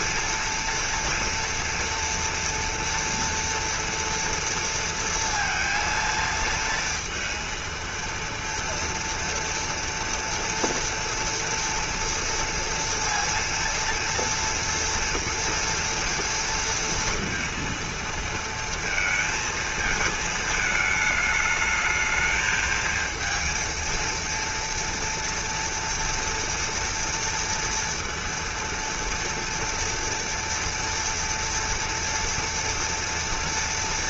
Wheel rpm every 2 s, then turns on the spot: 230, 230, 230, 230, 230, 230, 230, 230, 230, 230, 220, 220, 230, 230, 230, 230, 230.
none